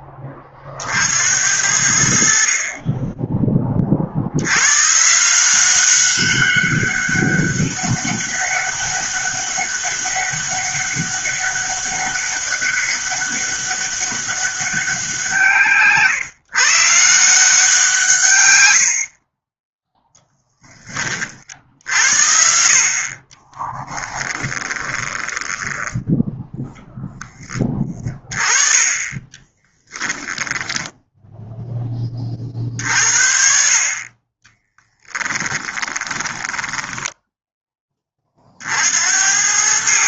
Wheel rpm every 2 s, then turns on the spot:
60, 20, 140, 200, 200, 200, 200, 190, 170, 60, 30, 40, 10, 0, 20, 10, 50, 10, 10, 80.
24-26 34-38